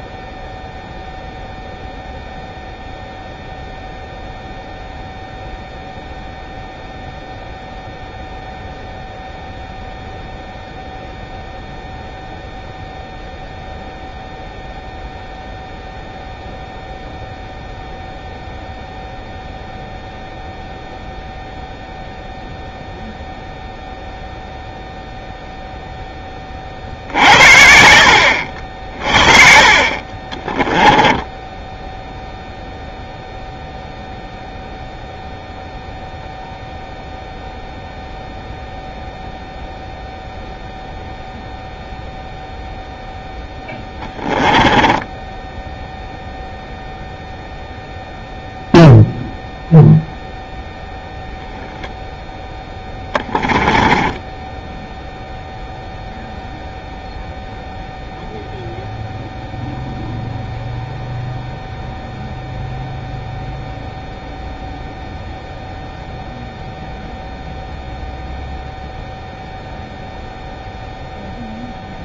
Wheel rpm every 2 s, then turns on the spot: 0, 0, 0, 0, 0, 0, 0, 0, 0, 0, 0, 0, 0, 50, 50, 20, 0, 0, 0, 0, 0, 0, 10, 0, 0, 0, 10, 0, 0, 0, 0, 0, 0, 0, 0, 0.
30-32 44-46 52-54